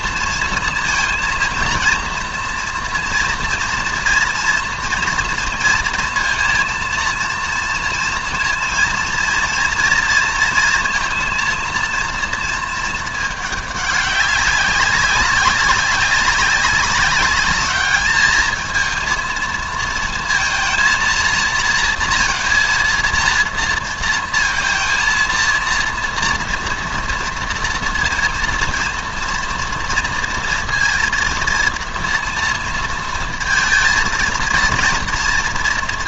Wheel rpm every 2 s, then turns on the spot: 230, 230, 230, 230, 230, 230, 220, 200, 190, 220, 230, 230, 230, 230, 230, 230, 230, 230.
none